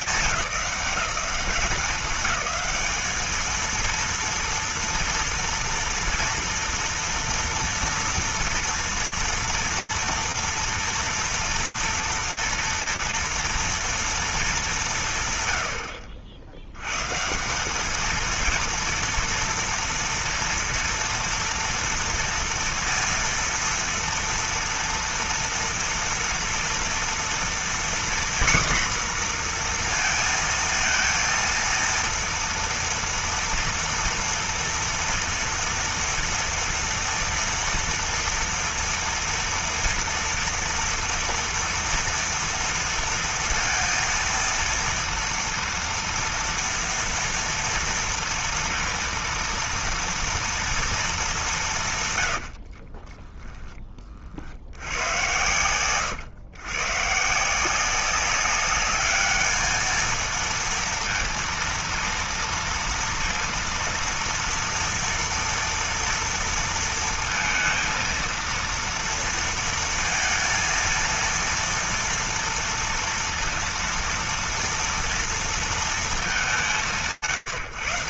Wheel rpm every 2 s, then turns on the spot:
200, 210, 230, 230, 230, 230, 230, 130, 150, 230, 230, 230, 230, 230, 240, 230, 230, 230, 230, 230, 230, 230, 230, 230, 230, 230, 80, 70, 130, 200, 220, 230, 230, 230, 230, 230, 230, 230, 210.
52-54